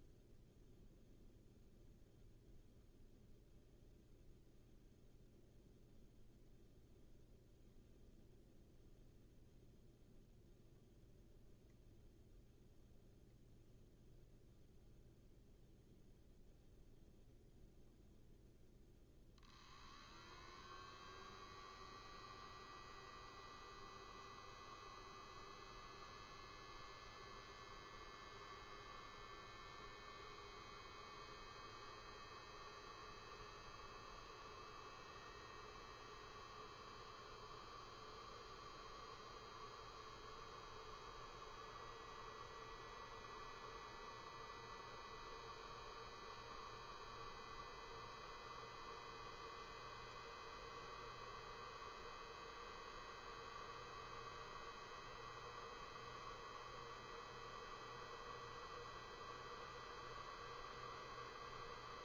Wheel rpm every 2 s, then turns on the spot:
0, 0, 0, 0, 0, 0, 0, 0, 0, 0, 0, 0, 0, 0, 0, 0, 0, 0, 0, 0, 0, 0, 0, 0, 0, 0, 0, 0, 0, 0, 0.
none